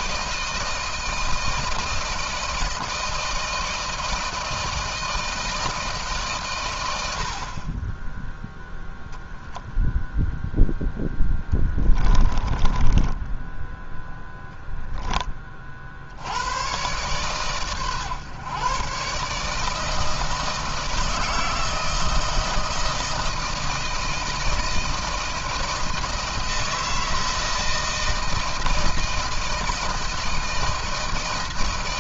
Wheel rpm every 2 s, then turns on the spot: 160, 160, 160, 100, 0, 0, 20, 0, 110, 140, 160, 160, 160, 160, 160, 160.
12-14